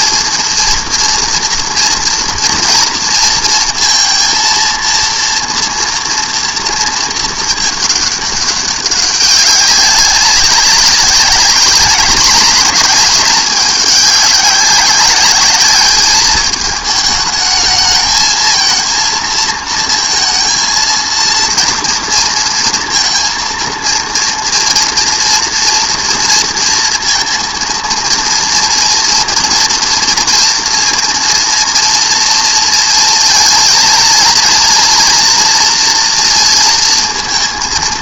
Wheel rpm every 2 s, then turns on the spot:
230, 230, 230, 230, 200, 190, 210, 200, 210, 220, 230, 230, 230, 230, 230, 230, 230, 240, 230.
none